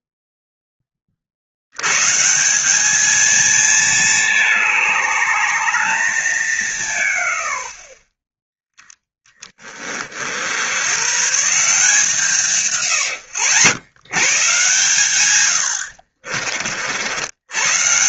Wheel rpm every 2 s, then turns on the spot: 10, 190, 210, 190, 10, 80, 160, 140, 50.
none